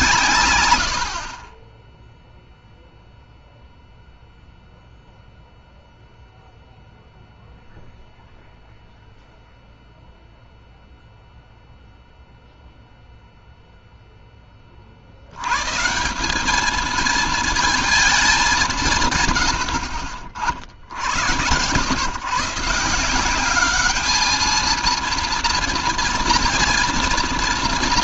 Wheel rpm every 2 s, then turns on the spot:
120, 0, 0, 0, 0, 0, 0, 30, 210, 190, 60, 150, 220, 230.
none